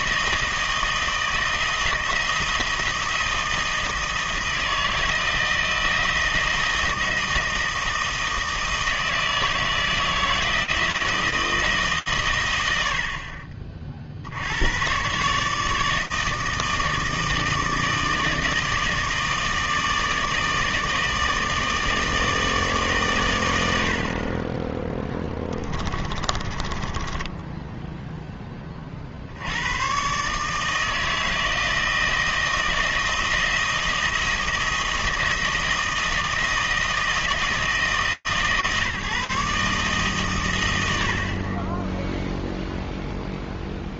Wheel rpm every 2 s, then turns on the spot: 160, 160, 160, 160, 160, 160, 130, 80, 160, 160, 160, 160, 40, 20, 40, 160, 160, 160, 160, 150, 60, 0.
none